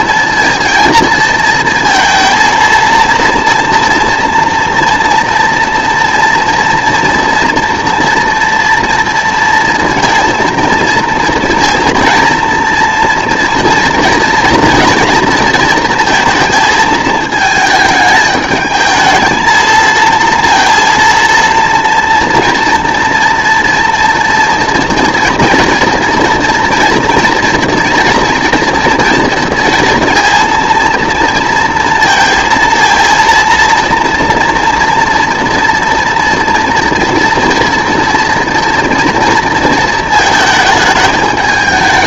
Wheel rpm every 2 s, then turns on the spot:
230, 230, 230, 230, 230, 230, 230, 230, 220, 220, 230, 230, 240, 230, 230, 230, 230, 230, 230, 230, 220.
none